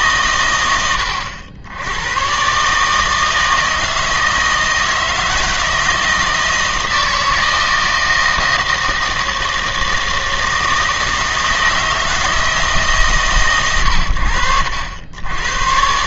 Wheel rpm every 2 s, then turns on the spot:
100, 130, 160, 160, 160, 160, 160, 90.
none